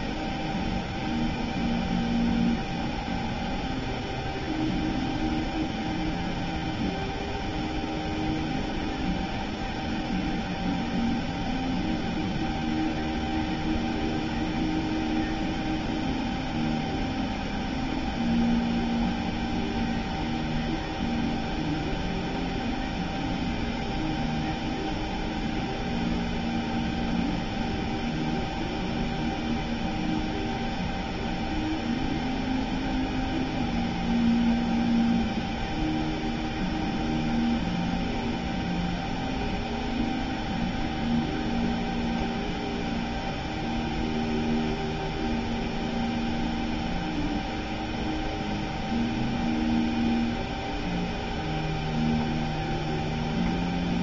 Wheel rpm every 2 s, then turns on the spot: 0, 0, 0, 0, 0, 0, 0, 0, 0, 0, 0, 0, 0, 0, 0, 0, 0, 0, 0, 0, 0, 0, 0, 0, 0, 0, 0.
none